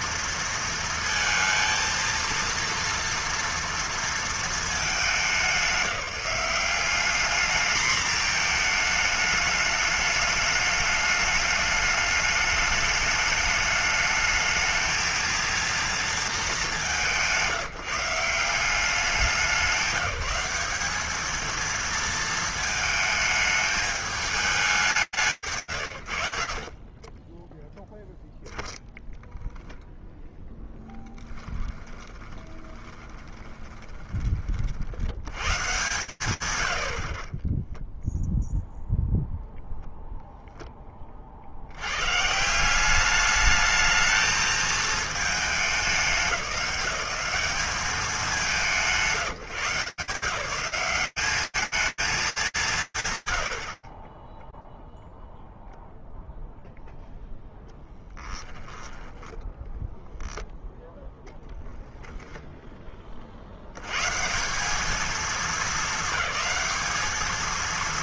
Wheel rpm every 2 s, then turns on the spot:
230, 230, 200, 200, 220, 210, 210, 220, 210, 190, 210, 220, 190, 40, 0, 10, 20, 80, 70, 0, 20, 200, 220, 180, 190, 190, 170, 0, 0, 10, 0, 80, 220, 230.
26-28 30-34 58-60